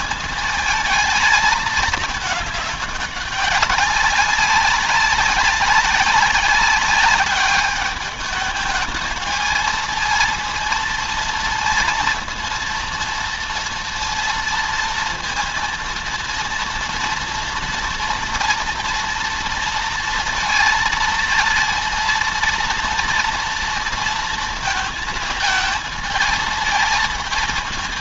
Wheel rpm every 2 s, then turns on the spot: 220, 210, 200, 200, 220, 230, 230, 230, 230, 230, 230, 230, 230, 220.
none